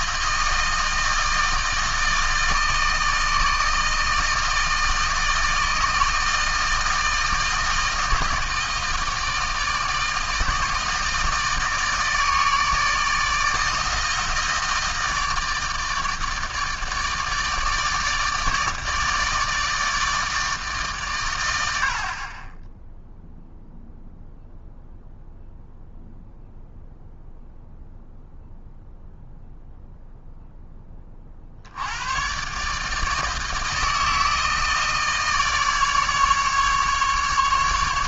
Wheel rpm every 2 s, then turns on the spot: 160, 160, 160, 160, 160, 160, 160, 160, 160, 150, 150, 10, 0, 0, 0, 10, 140, 160, 150.
none